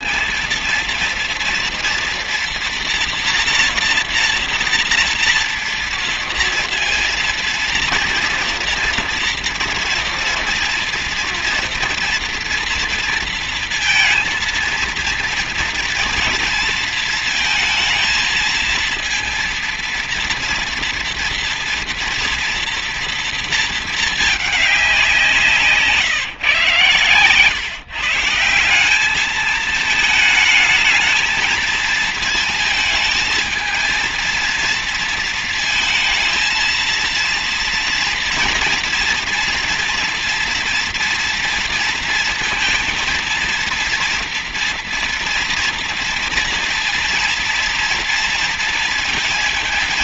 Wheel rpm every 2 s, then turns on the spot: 230, 230, 230, 230, 230, 230, 230, 230, 230, 230, 230, 230, 200, 140, 190, 220, 220, 230, 230, 230, 230, 230, 230, 230, 230.
none